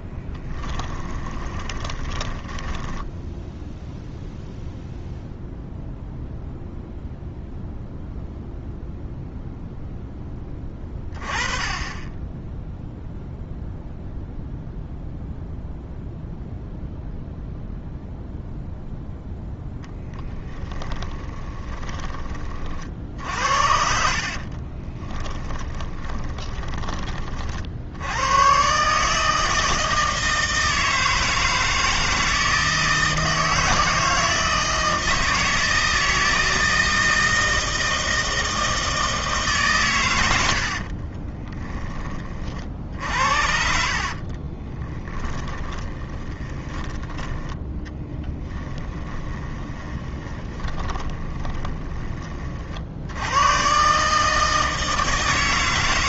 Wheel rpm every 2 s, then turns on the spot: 20, 10, 0, 0, 0, 20, 0, 0, 0, 0, 10, 40, 30, 20, 130, 160, 160, 160, 160, 160, 60, 50, 20, 10, 10, 20, 50, 160.
0-4 20-22 24-28 40-42 44-46 48-52